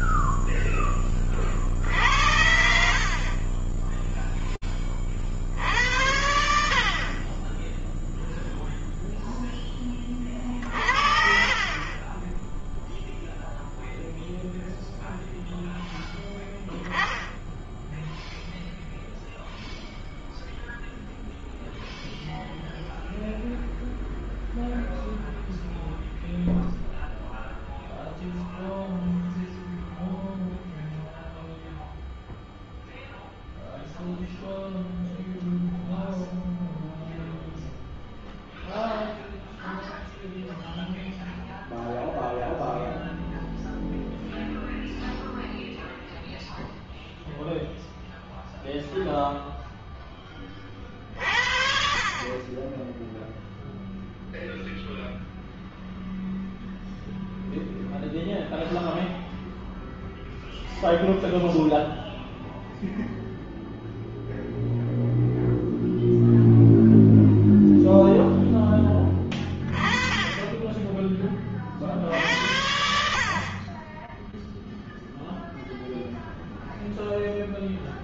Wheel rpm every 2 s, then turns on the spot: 0, 60, 20, 50, 0, 50, 0, 0, 10, 0, 0, 0, 0, 0, 0, 0, 0, 0, 0, 0, 0, 0, 0, 0, 0, 40, 0, 0, 0, 0, 0, 0, 0, 0, 20, 20, 60, 0, 0.
none